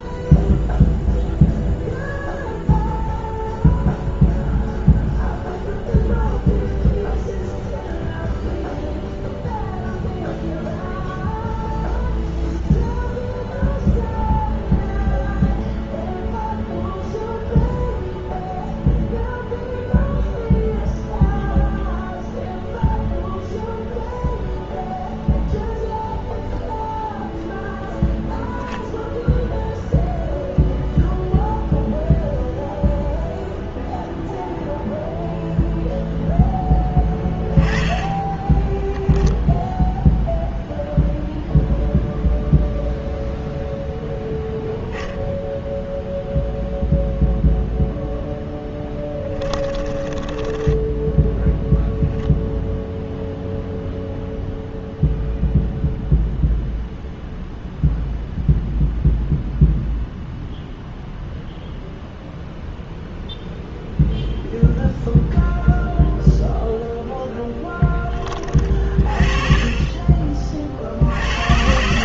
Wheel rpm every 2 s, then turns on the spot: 0, 0, 0, 0, 0, 0, 0, 0, 0, 0, 0, 0, 0, 0, 0, 0, 0, 0, 10, 10, 0, 0, 0, 0, 10, 10, 0, 0, 0, 0, 0, 0, 0, 0, 40, 60.
36-40